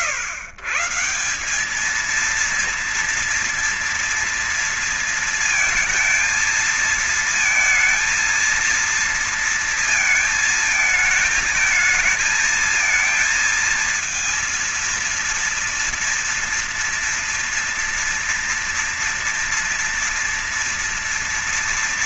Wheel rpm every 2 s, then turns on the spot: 140, 230, 230, 230, 230, 220, 230, 230, 230, 230, 240.
none